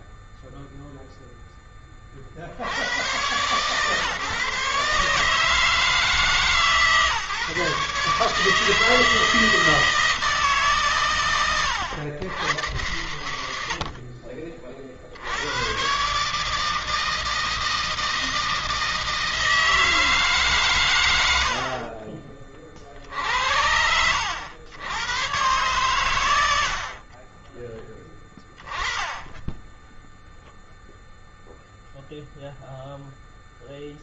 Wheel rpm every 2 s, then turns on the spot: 0, 70, 150, 150, 150, 150, 100, 50, 150, 160, 130, 40, 90, 70, 20, 0, 0.
none